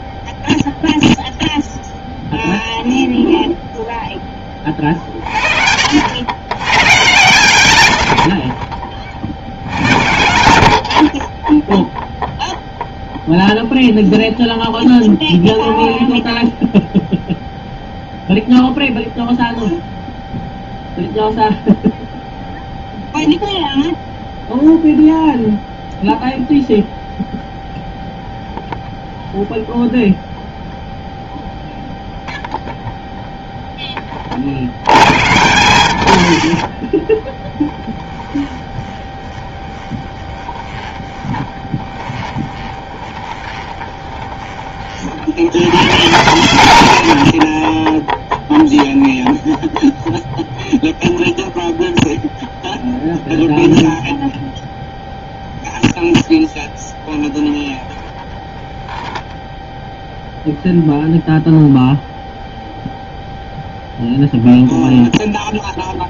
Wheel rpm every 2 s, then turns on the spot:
0, 0, 30, 120, 40, 100, 0, 0, 0, 0, 0, 0, 0, 0, 0, 0, 0, 60, 40, 20, 20, 20, 30, 110, 0, 0, 0, 0, 10, 10, 0, 0, 0.
38-44 58-60